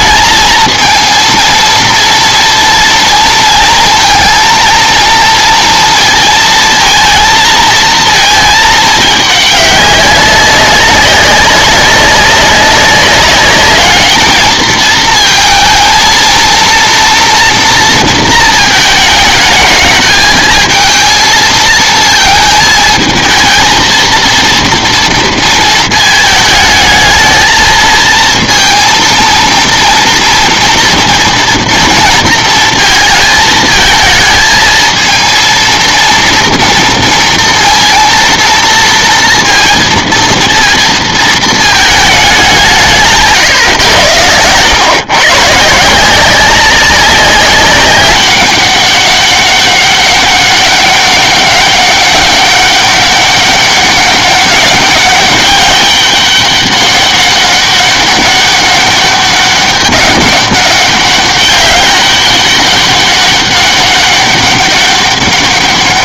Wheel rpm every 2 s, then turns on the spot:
220, 230, 230, 220, 220, 200, 200, 220, 230, 220, 220, 220, 230, 210, 230, 230, 230, 230, 230, 230, 230, 200, 110, 190, 200, 200, 200, 200, 200, 200, 200, 200, 200.
none